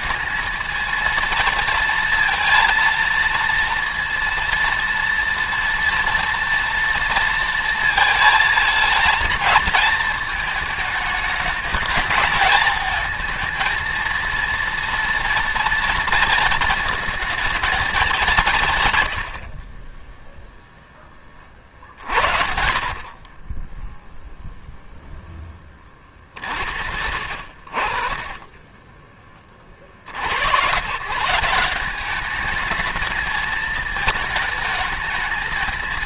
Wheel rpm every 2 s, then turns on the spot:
220, 230, 230, 230, 220, 220, 220, 230, 220, 140, 0, 40, 0, 70, 20, 130, 210, 220.
none